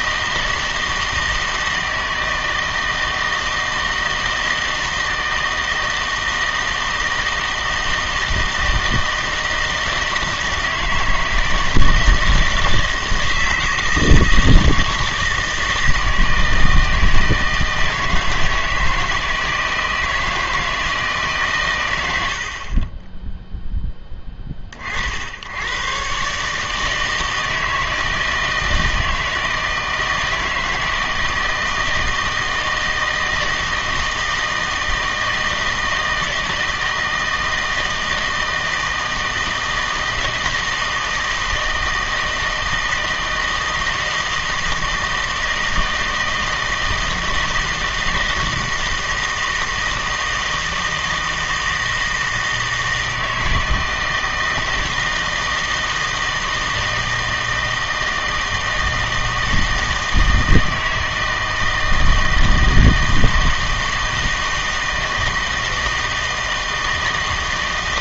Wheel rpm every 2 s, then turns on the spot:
160, 160, 160, 160, 160, 160, 160, 160, 160, 160, 160, 40, 40, 150, 160, 160, 160, 160, 160, 160, 160, 160, 160, 160, 160, 160, 160, 160, 160, 160, 160, 160, 160, 160.
none